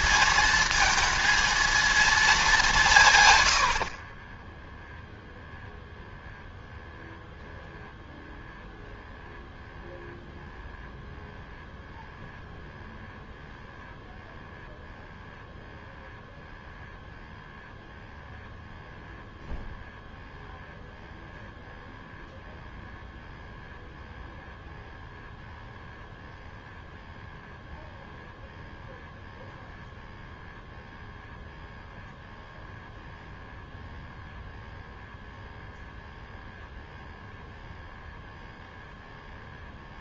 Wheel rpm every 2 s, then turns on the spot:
220, 170, 10, 0, 0, 0, 0, 0, 0, 0, 0, 0, 0, 0, 0, 0, 0, 0, 0, 0.
none